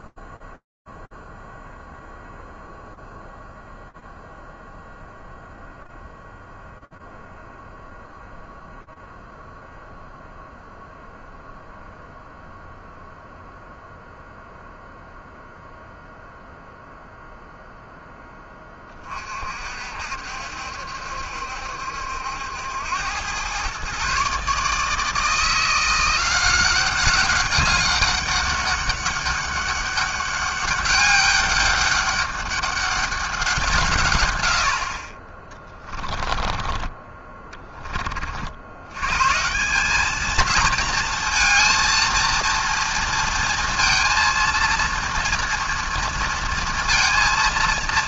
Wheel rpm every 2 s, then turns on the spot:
0, 0, 0, 0, 0, 0, 0, 0, 0, 10, 60, 70, 130, 170, 200, 200, 200, 150, 20, 20, 200, 230, 230, 230.
36-38